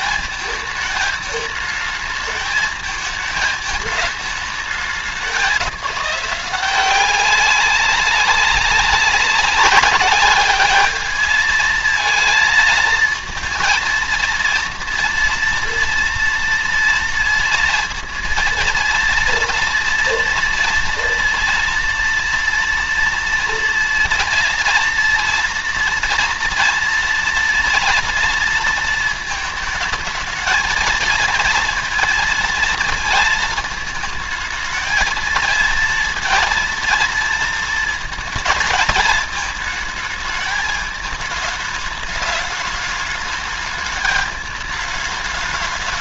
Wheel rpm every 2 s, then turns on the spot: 220, 220, 190, 190, 190, 210, 220, 230, 230, 230, 230, 230, 230, 230, 230, 220, 230, 220, 230, 220, 220, 210, 210.
none